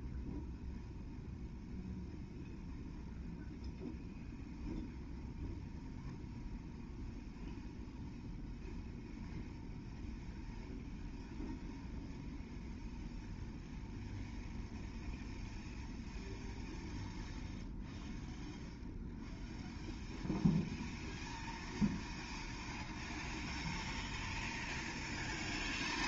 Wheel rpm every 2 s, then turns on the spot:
0, 0, 0, 0, 0, 0, 0, 0, 0, 0, 0, 0, 0.
none